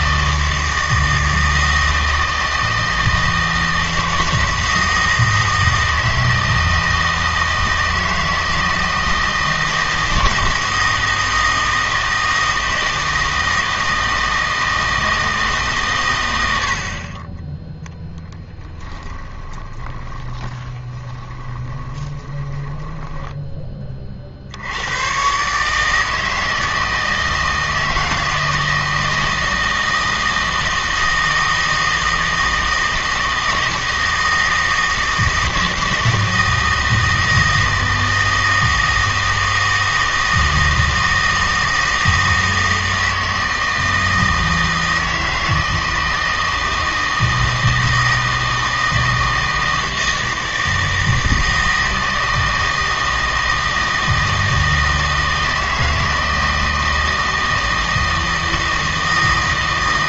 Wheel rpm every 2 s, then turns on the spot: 160, 160, 160, 160, 160, 160, 160, 160, 80, 10, 20, 20, 90, 160, 160, 160, 160, 160, 160, 160, 160, 160, 160, 160, 160, 160, 160, 160, 160, 160.
18-24